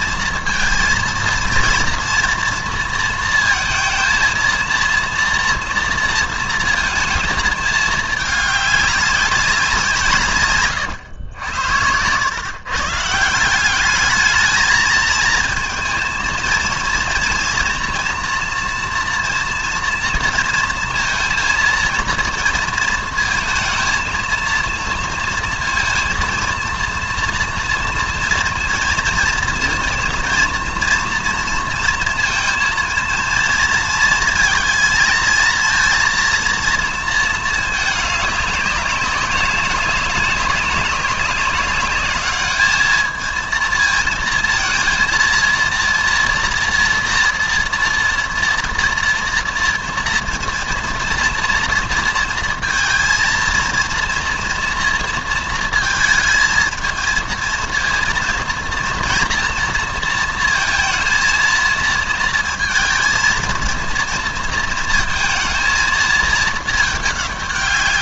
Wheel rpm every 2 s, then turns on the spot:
230, 230, 230, 230, 210, 120, 140, 220, 230, 240, 230, 230, 230, 230, 230, 240, 230, 230, 230, 200, 200, 220, 230, 230, 230, 230, 230, 230, 220, 230, 230, 230, 230, 210.
none